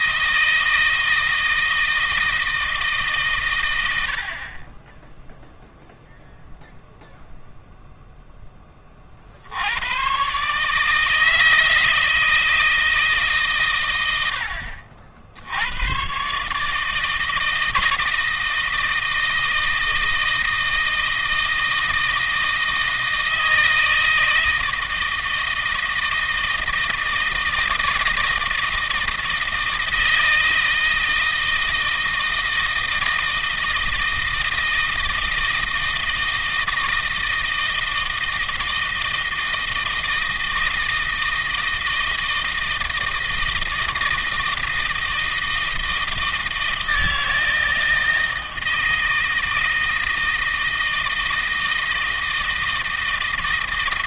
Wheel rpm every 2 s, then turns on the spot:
160, 150, 20, 0, 30, 150, 150, 70, 150, 160, 160, 160, 160, 160, 160, 160, 160, 160, 160, 160, 160, 160, 160, 160, 160, 160, 160.
none